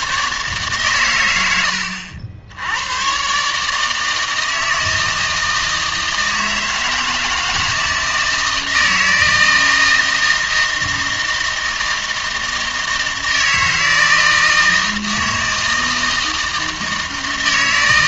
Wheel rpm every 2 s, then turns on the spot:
130, 80, 160, 160, 160, 160, 160, 160, 160.
none